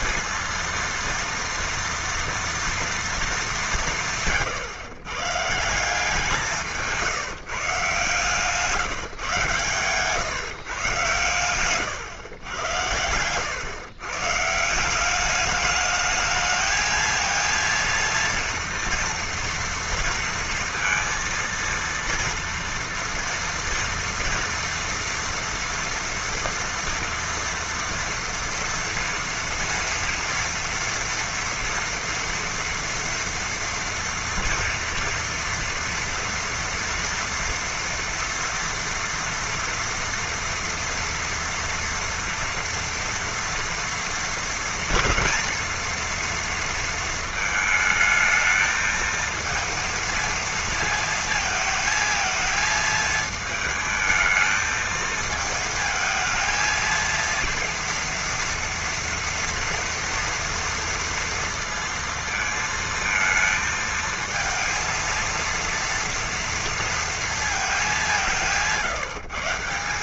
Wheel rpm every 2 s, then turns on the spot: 230, 230, 120, 170, 150, 130, 130, 130, 210, 230, 230, 230, 230, 240, 230, 230, 230, 230, 230, 230, 230, 230, 230, 230, 220, 230, 220, 220, 220, 230, 240, 230, 220, 230, 180.
8-10